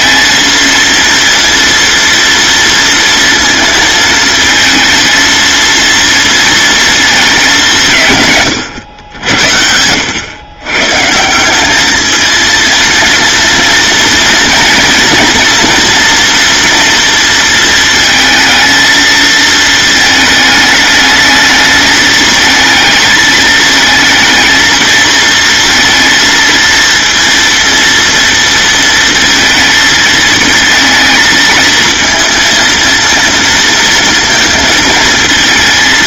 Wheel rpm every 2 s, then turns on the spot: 230, 230, 230, 220, 90, 140, 230, 240, 230, 220, 220, 220, 230, 230, 230, 220, 230, 220.
none